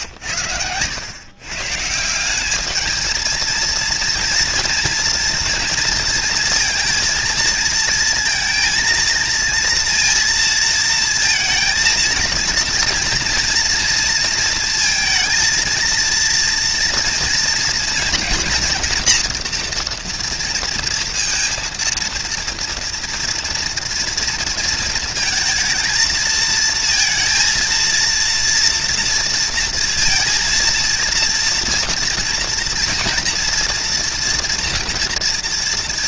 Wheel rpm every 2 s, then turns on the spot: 110, 220, 230, 230, 230, 230, 230, 230, 230, 240, 230, 230, 230, 220, 230, 230, 230, 230.
none